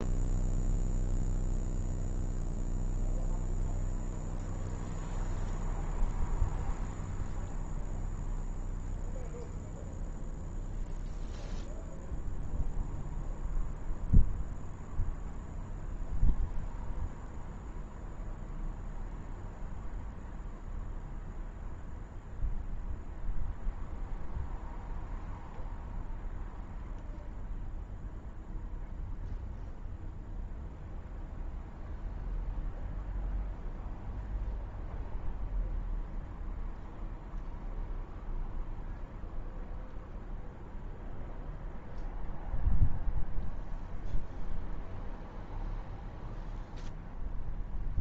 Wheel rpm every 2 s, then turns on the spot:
0, 0, 0, 0, 0, 0, 0, 0, 0, 0, 0, 0, 0, 0, 0, 0, 0, 0, 0, 0, 0, 0, 0, 0.
none